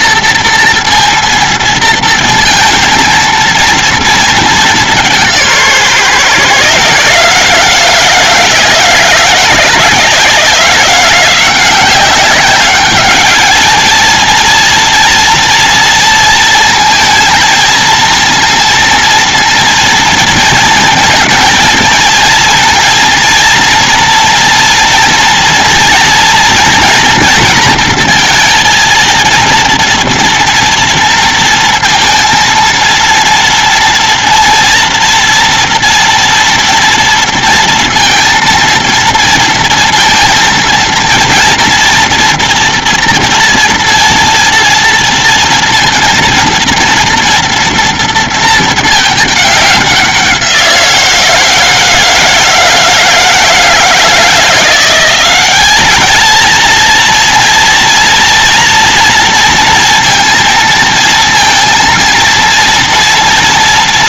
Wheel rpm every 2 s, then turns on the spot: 230, 230, 230, 140, 160, 160, 190, 220, 230, 230, 230, 230, 240, 230, 230, 230, 230, 230, 230, 230, 230, 240, 230, 230, 230, 190, 160, 160, 220, 230, 230, 230.
none